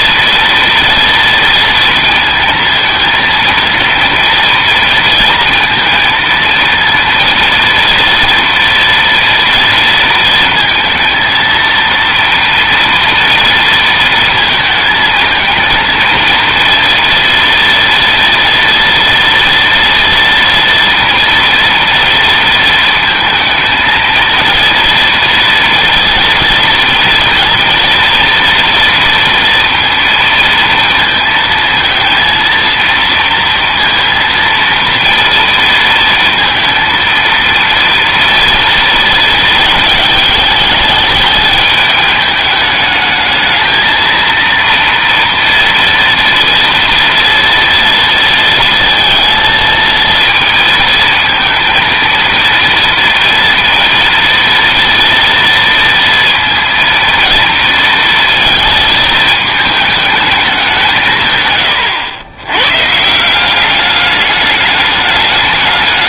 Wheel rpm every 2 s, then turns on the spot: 230, 230, 230, 230, 230, 230, 230, 220, 230, 230, 230, 230, 230, 230, 230, 230, 230, 230, 230, 230, 210, 210, 230, 230, 230, 230, 240, 230, 230, 230, 180, 130, 200.
none